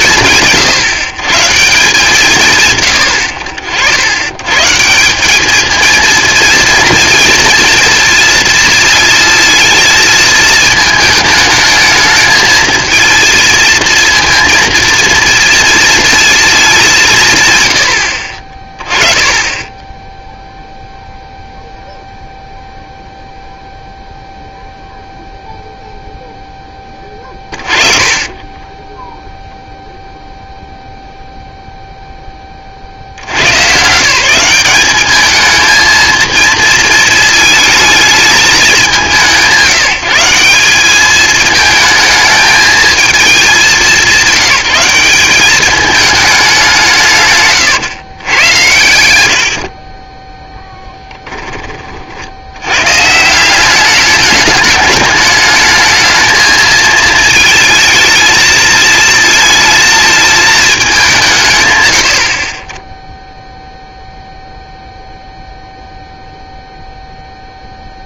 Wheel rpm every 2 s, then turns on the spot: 150, 130, 130, 230, 230, 220, 220, 230, 220, 40, 0, 0, 0, 10, 20, 0, 30, 190, 230, 200, 190, 220, 200, 190, 120, 10, 90, 210, 220, 220, 210, 30, 0, 0.
28-30